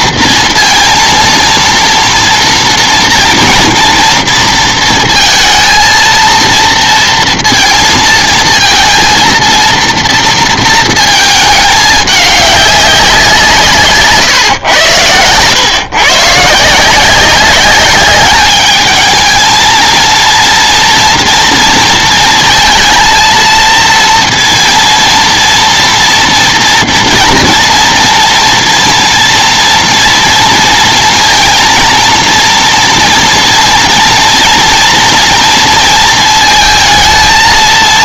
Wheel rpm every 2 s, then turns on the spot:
230, 230, 230, 230, 230, 230, 200, 120, 150, 210, 230, 230, 230, 230, 230, 230, 230, 230, 220.
none